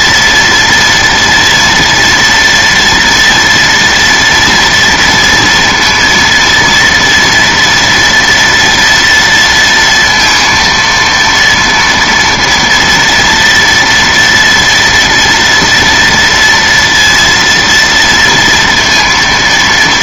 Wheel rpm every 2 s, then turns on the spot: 230, 230, 230, 230, 230, 230, 230, 240, 230, 230.
none